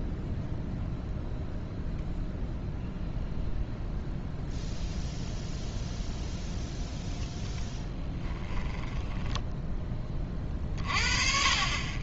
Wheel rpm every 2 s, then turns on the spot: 0, 0, 0, 0, 10, 40.
8-10